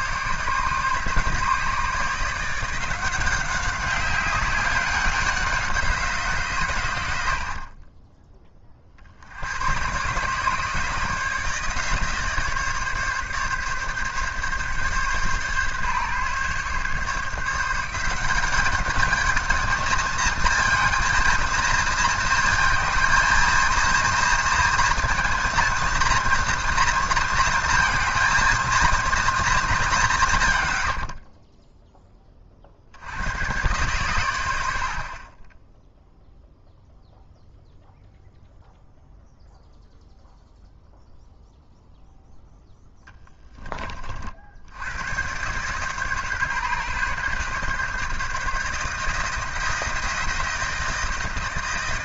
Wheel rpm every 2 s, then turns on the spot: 150, 170, 190, 130, 30, 150, 150, 140, 140, 200, 230, 220, 230, 230, 220, 100, 60, 70, 0, 0, 0, 0, 80, 130, 150, 160.
none